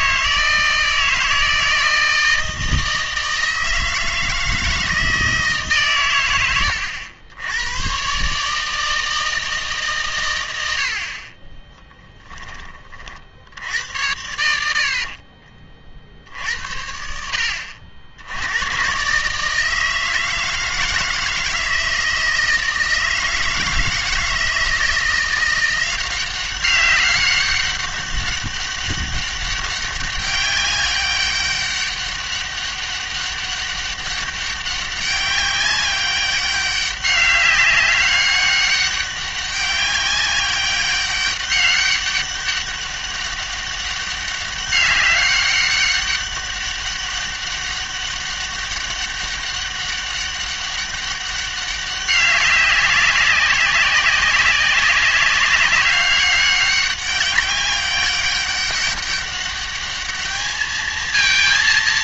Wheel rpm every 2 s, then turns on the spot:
160, 160, 160, 90, 160, 70, 30, 60, 70, 110, 160, 160, 170, 200, 200, 200, 200, 190, 200, 200, 200, 200, 200, 200, 200, 200, 190, 190, 200, 200, 220.
14-16